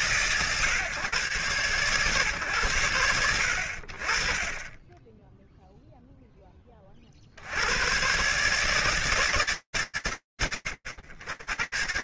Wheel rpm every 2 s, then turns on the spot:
150, 110, 30, 20, 120, 80.
none